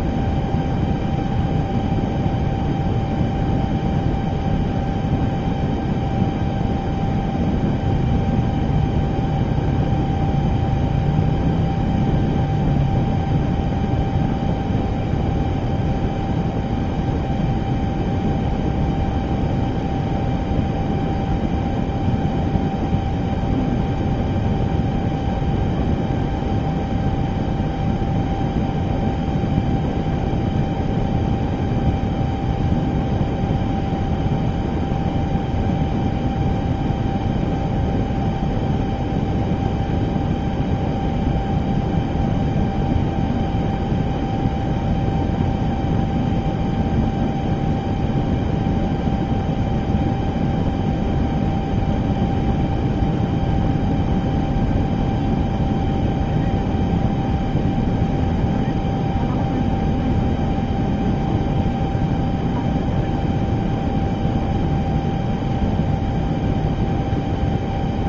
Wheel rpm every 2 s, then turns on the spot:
0, 0, 0, 0, 0, 0, 0, 0, 0, 0, 0, 0, 0, 0, 0, 0, 0, 0, 0, 0, 0, 0, 0, 0, 0, 0, 0, 0, 0, 0, 0, 0, 0, 0.
none